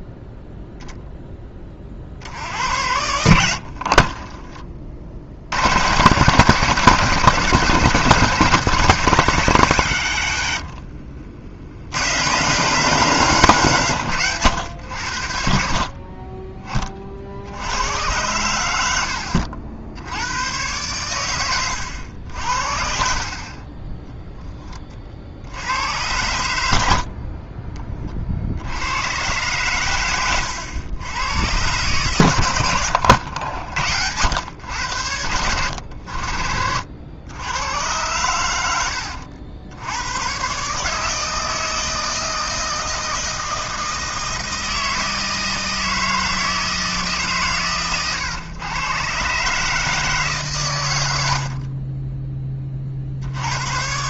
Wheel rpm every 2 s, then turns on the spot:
0, 80, 40, 160, 170, 70, 160, 110, 20, 90, 110, 60, 20, 80, 70, 100, 110, 100, 70, 90, 130, 160, 160, 160, 120, 120, 40.
10-12 32-34